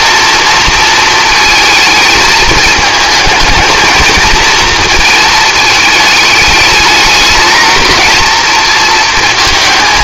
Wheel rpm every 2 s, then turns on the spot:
230, 220, 230, 210, 230.
none